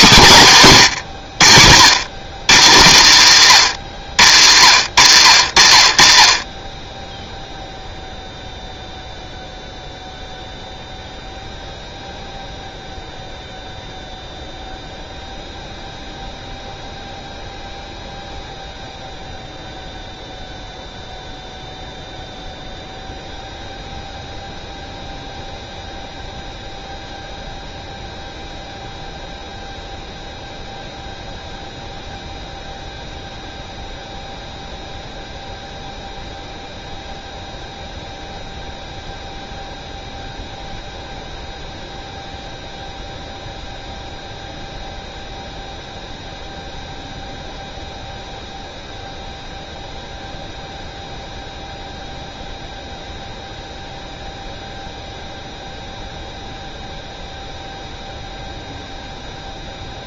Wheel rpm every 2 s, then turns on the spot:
160, 120, 70, 30, 0, 0, 0, 0, 0, 0, 0, 0, 0, 0, 0, 0, 0, 0, 0, 0, 0, 0, 0, 0, 0, 0, 0, 0, 0, 0.
none